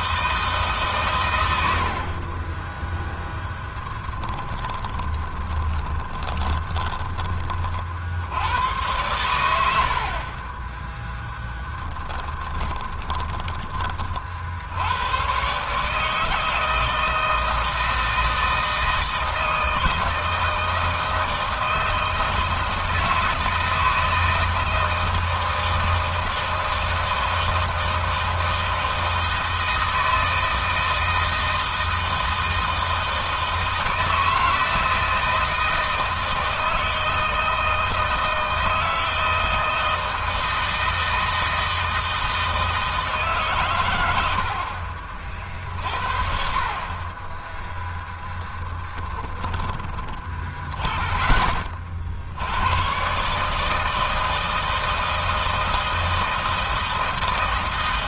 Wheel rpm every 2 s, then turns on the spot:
140, 10, 10, 20, 100, 10, 20, 90, 160, 160, 160, 160, 160, 160, 160, 160, 160, 160, 160, 160, 160, 150, 50, 30, 10, 20, 110, 160, 160.
4-8 12-14 48-50